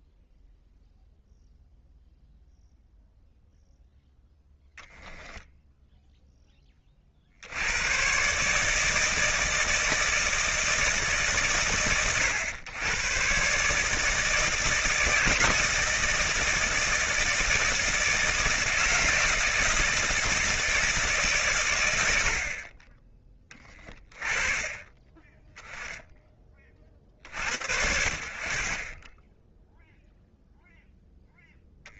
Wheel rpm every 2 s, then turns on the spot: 0, 0, 10, 0, 140, 160, 120, 160, 160, 160, 160, 40, 20, 60, 10, 0.
none